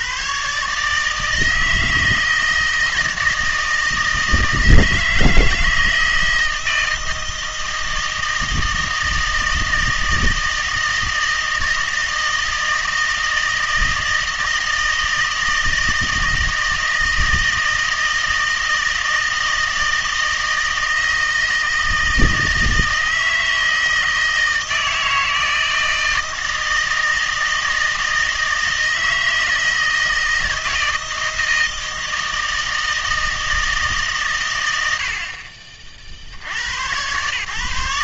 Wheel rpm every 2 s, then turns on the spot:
140, 160, 160, 160, 160, 160, 160, 160, 160, 160, 160, 160, 160, 160, 160, 160, 160, 100, 90.
none